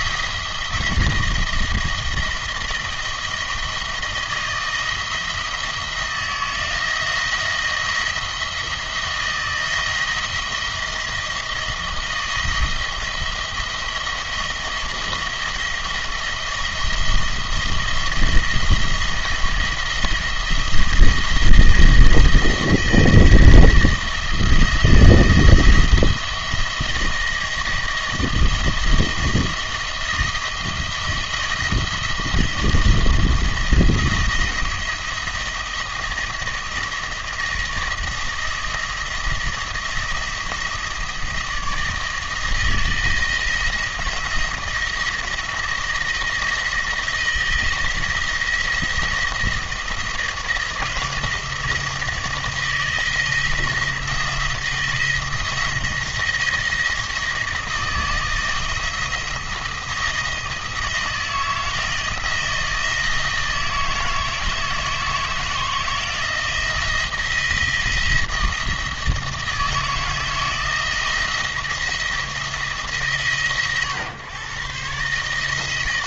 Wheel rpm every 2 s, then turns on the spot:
170, 170, 170, 160, 160, 160, 170, 170, 170, 170, 170, 170, 170, 170, 170, 170, 160, 170, 170, 170, 170, 160, 160, 160, 170, 170, 170, 170, 170, 160, 160, 160, 160, 170, 160, 160, 160, 130.
none